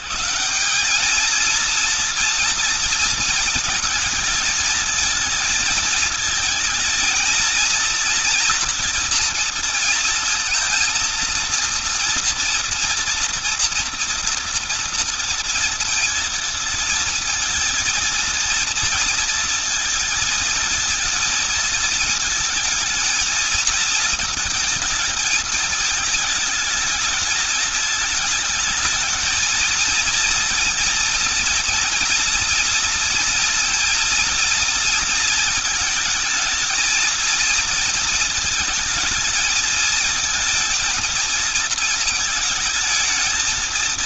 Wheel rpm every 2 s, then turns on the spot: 210, 230, 220, 220, 230, 230, 230, 230, 230, 230, 220, 220, 220, 220, 220, 230, 240, 230, 230, 220, 230, 220.
none